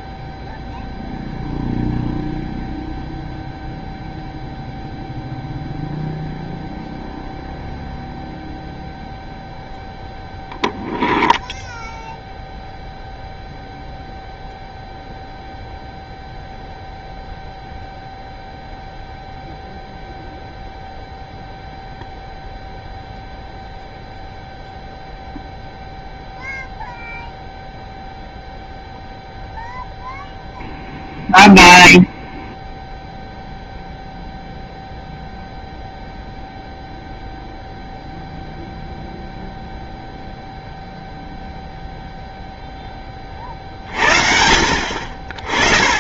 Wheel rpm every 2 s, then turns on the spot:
0, 0, 0, 0, 0, 0, 0, 0, 0, 0, 0, 0, 0, 0, 0, 0, 0, 0, 0, 0, 0, 10, 40.
none